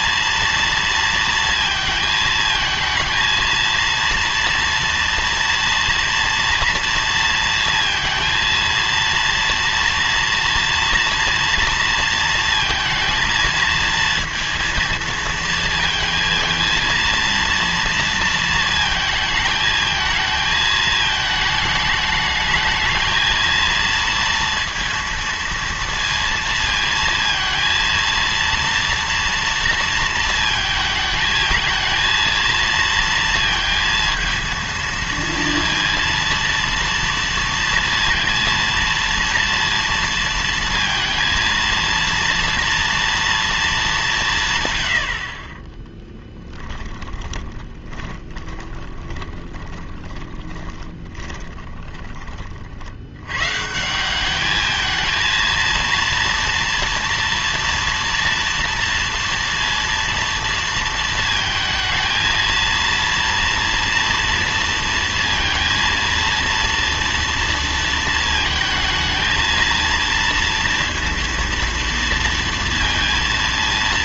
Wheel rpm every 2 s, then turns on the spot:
230, 220, 230, 230, 230, 230, 230, 230, 230, 230, 220, 210, 230, 230, 230, 220, 230, 230, 230, 230, 230, 230, 130, 10, 20, 20, 40, 210, 240, 230, 230, 230, 230, 230, 230, 230, 230.
46-52